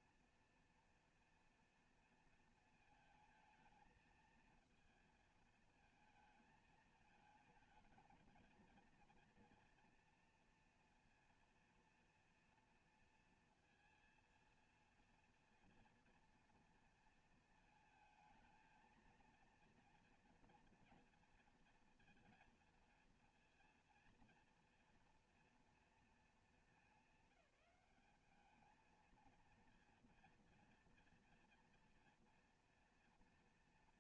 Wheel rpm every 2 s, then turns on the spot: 240, 230, 230, 220, 230, 230, 230, 230, 230, 220, 230, 230, 230, 220, 210, 230, 230.
none